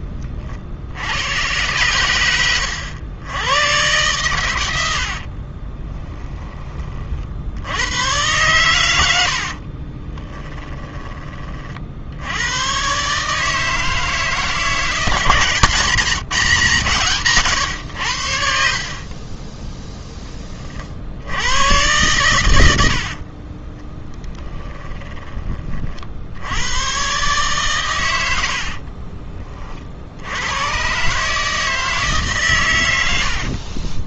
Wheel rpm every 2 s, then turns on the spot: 70, 100, 90, 30, 100, 10, 120, 160, 150, 50, 60, 70, 10, 110, 50, 120, 100.
4-6 22-26 28-30